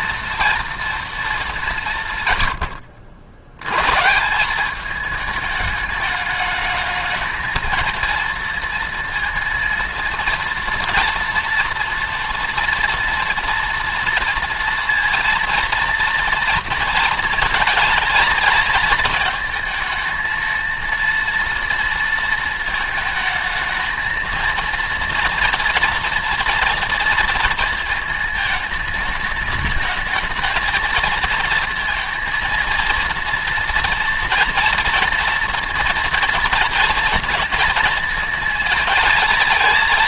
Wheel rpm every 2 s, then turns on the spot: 230, 100, 200, 210, 230, 240, 230, 230, 230, 220, 230, 220, 230, 230, 220, 220, 230, 230, 230, 220.
none